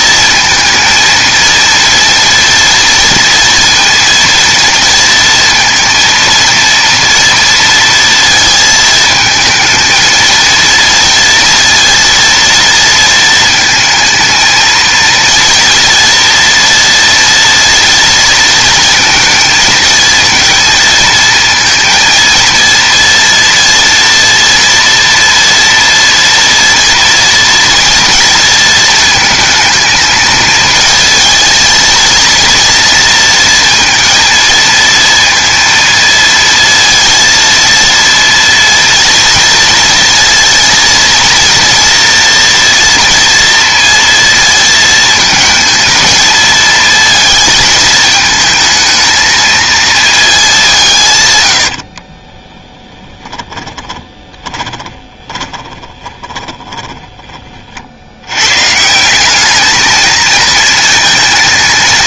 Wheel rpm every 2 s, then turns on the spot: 230, 230, 230, 230, 220, 230, 230, 230, 230, 220, 220, 230, 230, 230, 220, 220, 230, 230, 230, 230, 230, 240, 230, 220, 220, 170, 30, 20, 10, 150, 230.
52-58